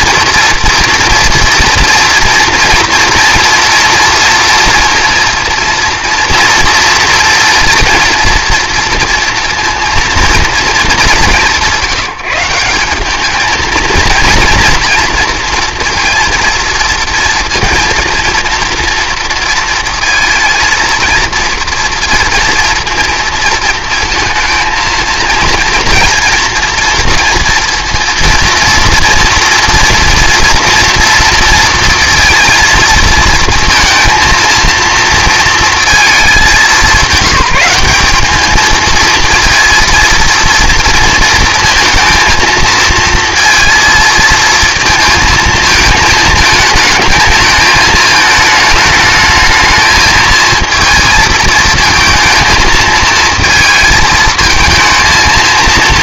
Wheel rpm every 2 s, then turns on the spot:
230, 230, 230, 230, 230, 210, 180, 240, 230, 230, 230, 230, 230, 230, 230, 230, 230, 230, 200, 220, 230, 230, 220, 220, 220, 220, 220, 220.
none